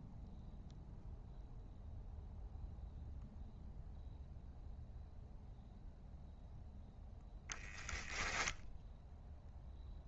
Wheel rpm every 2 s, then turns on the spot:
0, 0, 0, 0, 0.
none